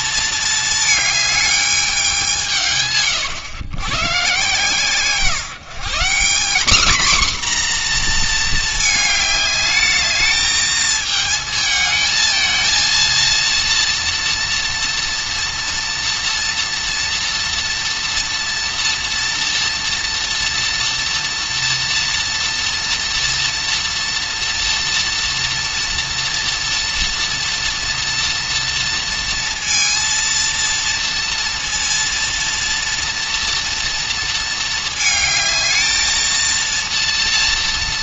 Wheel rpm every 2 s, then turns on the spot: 220, 150, 140, 230, 220, 220, 220, 230, 230, 230, 230, 230, 230, 230, 230, 230, 230, 220, 230.
none